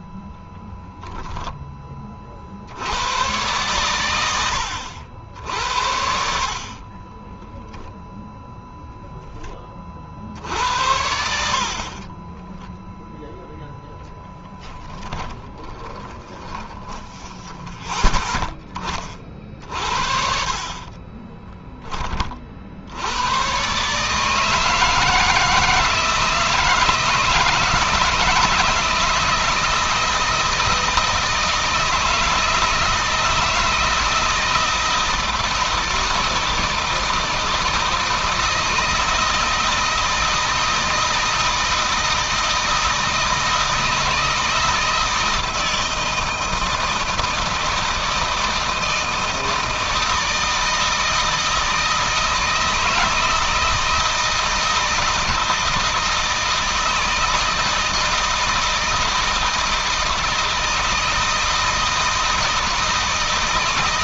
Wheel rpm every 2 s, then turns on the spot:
10, 80, 110, 50, 0, 60, 10, 10, 20, 20, 50, 60, 160, 160, 160, 160, 160, 160, 160, 160, 160, 160, 160, 160, 160, 160, 160, 160, 160, 160, 160, 160.
12-18 20-22